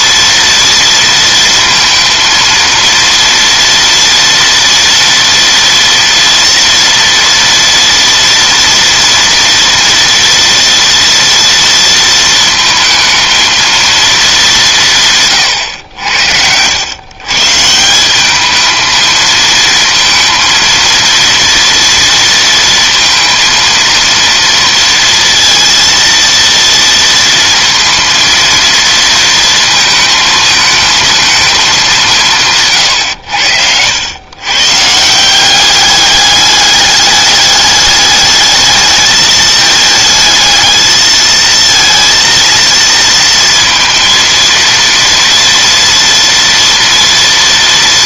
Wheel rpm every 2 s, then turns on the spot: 230, 230, 230, 230, 230, 230, 220, 160, 120, 220, 230, 230, 230, 230, 230, 220, 120, 160, 210, 220, 220, 230, 230, 230.
none